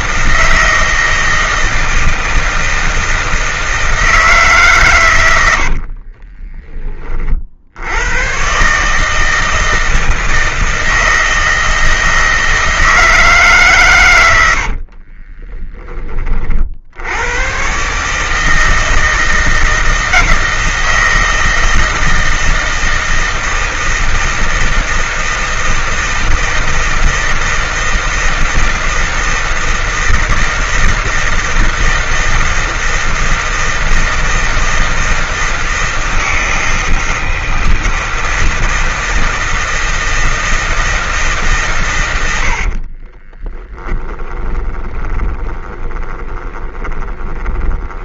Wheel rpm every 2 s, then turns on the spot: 160, 160, 140, 20, 140, 160, 160, 70, 50, 160, 160, 160, 160, 160, 160, 160, 170, 160, 160, 160, 160, 60, 20, 20.
14-16 44-48